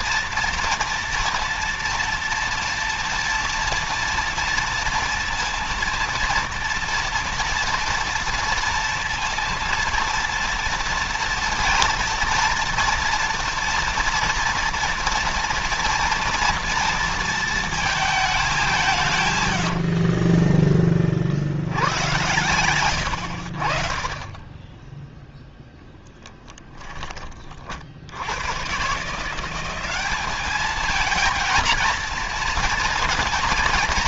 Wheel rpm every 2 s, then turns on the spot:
230, 230, 230, 230, 230, 230, 230, 230, 230, 190, 30, 110, 20, 20, 100, 210, 230.
20-24 26-28